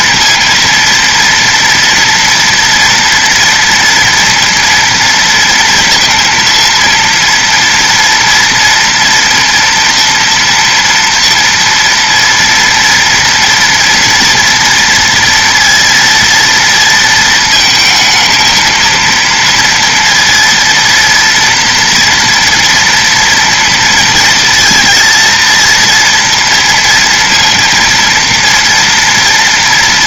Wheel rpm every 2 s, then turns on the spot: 230, 230, 230, 230, 230, 240, 230, 230, 230, 230, 230, 240, 230, 230, 230.
none